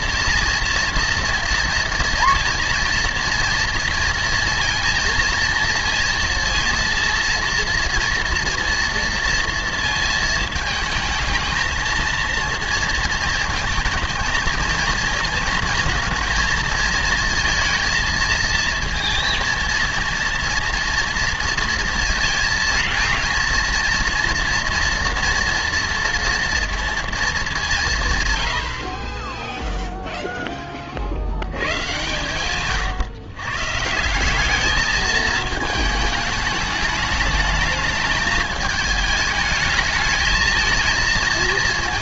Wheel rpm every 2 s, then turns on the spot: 230, 230, 230, 230, 230, 220, 230, 230, 230, 230, 230, 230, 240, 230, 80, 20, 130, 210, 210, 210, 220.
none